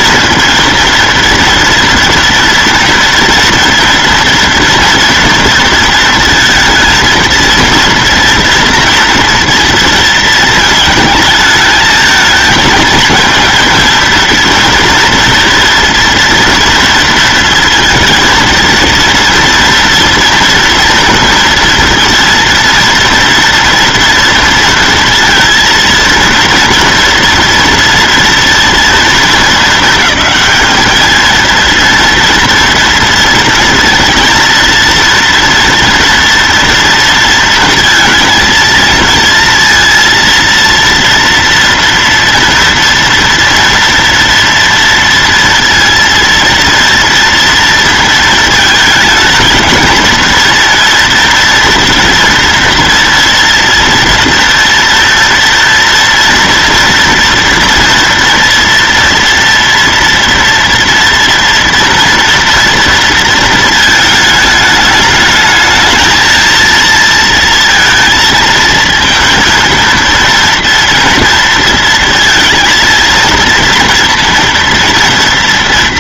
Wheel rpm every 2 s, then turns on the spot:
230, 240, 230, 230, 230, 220, 220, 230, 230, 230, 230, 230, 230, 230, 230, 220, 230, 230, 230, 220, 230, 230, 230, 230, 220, 230, 230, 230, 230, 230, 230, 230, 210, 230, 230, 230, 230, 230.
none